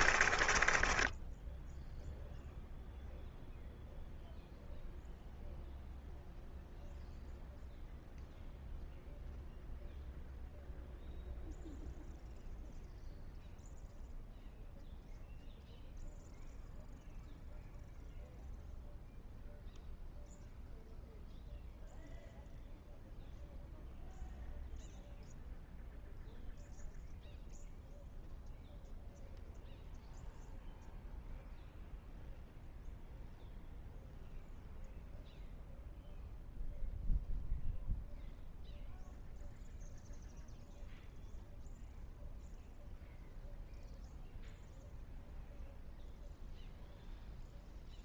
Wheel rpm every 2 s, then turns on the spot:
20, 0, 0, 0, 0, 0, 0, 0, 0, 0, 0, 0, 0, 0, 0, 0, 0, 0, 0, 0, 0, 0, 0, 0.
0-2